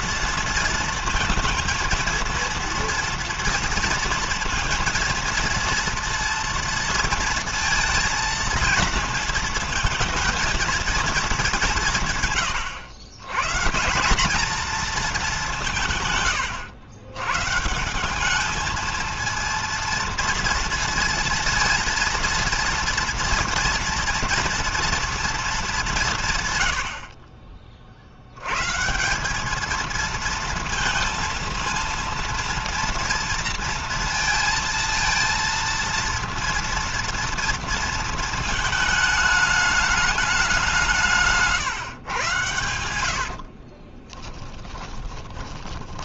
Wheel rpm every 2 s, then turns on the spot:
230, 230, 230, 230, 220, 220, 120, 220, 100, 220, 230, 230, 230, 80, 160, 230, 230, 230, 230, 220, 170, 90, 20.
42-46